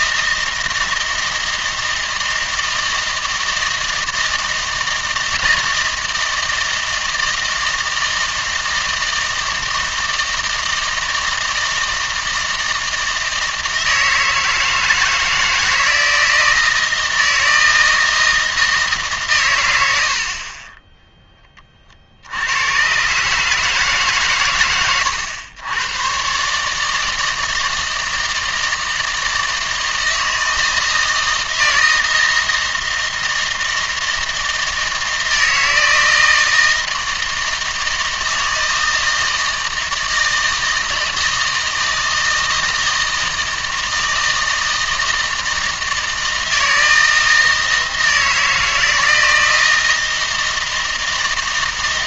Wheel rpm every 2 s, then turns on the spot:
160, 160, 160, 160, 160, 160, 160, 160, 160, 160, 20, 110, 120, 150, 160, 160, 160, 160, 160, 160, 160, 160, 160, 160, 160, 160.
none